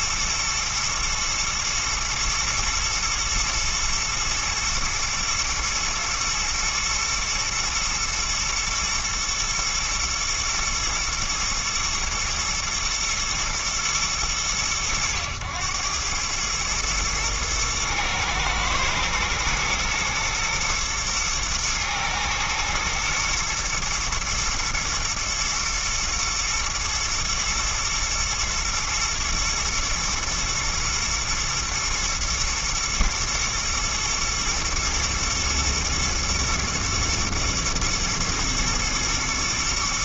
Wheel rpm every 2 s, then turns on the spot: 120, 120, 120, 120, 120, 120, 110, 90, 110, 110, 120, 110, 110, 110, 110, 120, 110, 120, 120, 120.
none